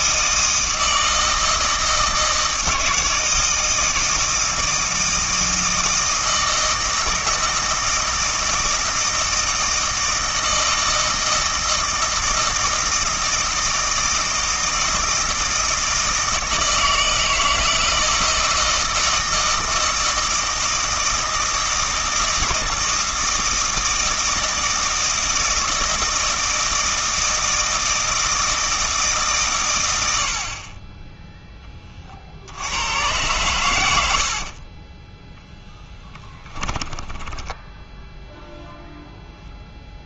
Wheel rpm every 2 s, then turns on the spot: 160, 160, 160, 160, 160, 160, 160, 160, 160, 160, 160, 160, 160, 160, 160, 40, 90, 30, 20, 0.
34-38